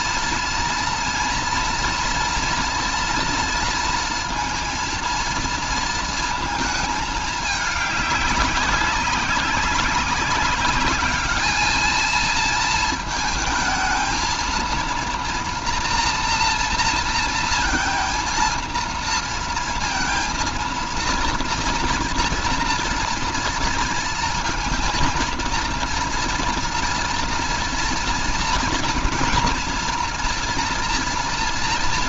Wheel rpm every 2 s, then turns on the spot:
230, 230, 230, 220, 200, 200, 230, 230, 230, 230, 230, 230, 230, 230, 230, 240.
none